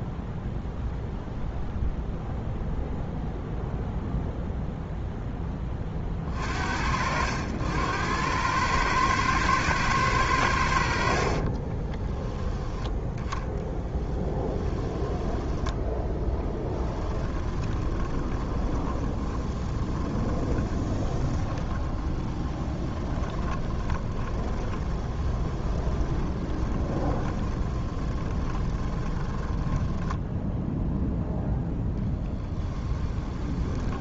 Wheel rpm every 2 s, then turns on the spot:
0, 0, 0, 60, 110, 70, 10, 20, 10, 20, 20, 20, 20, 20, 20, 0, 10.
10-12 14-30 32-34